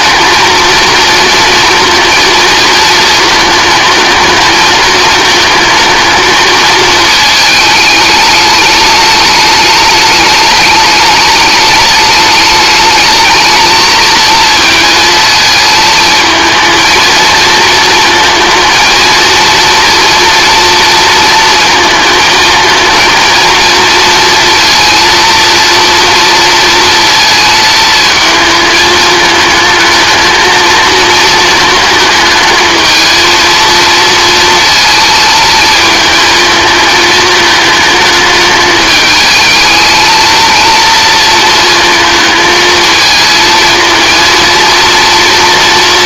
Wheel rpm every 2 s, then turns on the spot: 230, 220, 220, 220, 210, 210, 210, 220, 220, 230, 230, 220, 230, 230, 220, 220, 220, 220, 220, 210, 230, 220, 230.
none